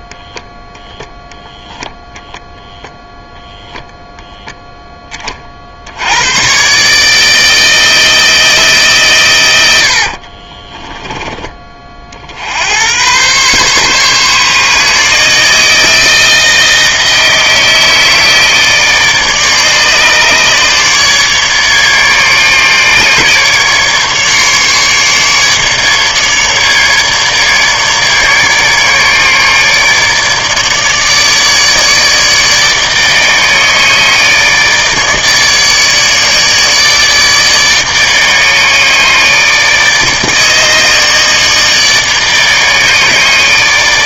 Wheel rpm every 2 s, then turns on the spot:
0, 0, 0, 120, 160, 30, 80, 140, 160, 160, 150, 150, 150, 150, 150, 150, 150, 150, 150, 150, 150, 150.
10-12